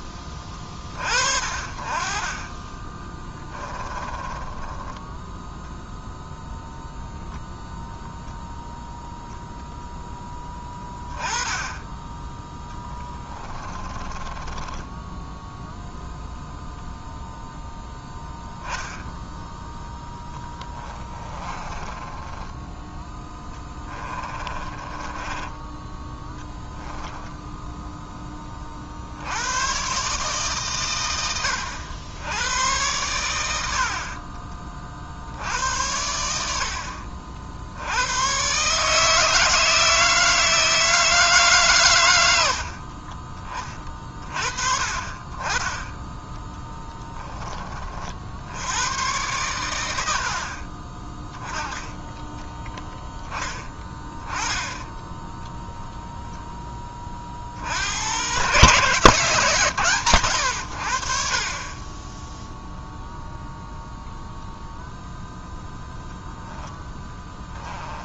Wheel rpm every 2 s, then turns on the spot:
30, 20, 10, 0, 0, 10, 10, 20, 0, 10, 20, 10, 20, 10, 50, 130, 100, 30, 70, 140, 160, 70, 40, 10, 90, 40, 10, 10, 10, 130, 100, 0, 0, 10.
2-6 12-16 20-26 46-48 66-68